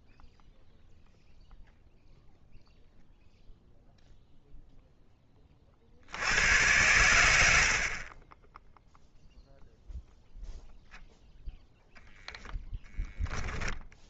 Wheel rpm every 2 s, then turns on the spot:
0, 0, 10, 110, 0, 0, 10.
12-14